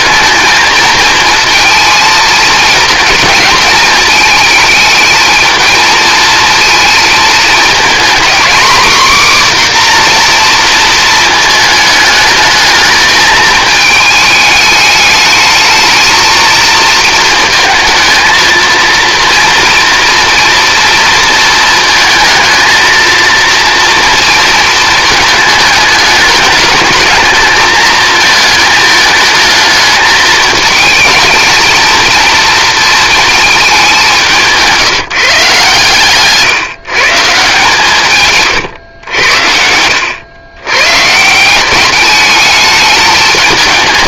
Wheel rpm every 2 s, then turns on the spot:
230, 230, 220, 230, 260, 230, 220, 210, 230, 230, 230, 230, 220, 210, 220, 220, 230, 180, 150, 130, 120, 210.
none